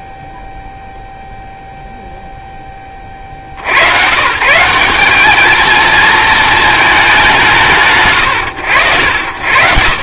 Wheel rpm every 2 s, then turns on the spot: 0, 0, 140, 230, 100.
none